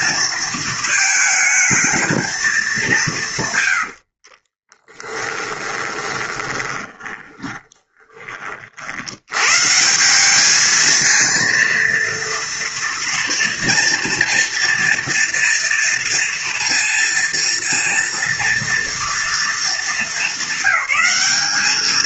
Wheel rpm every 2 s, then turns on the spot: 220, 220, 40, 20, 40, 200, 230, 230, 230, 230, 200.
4-8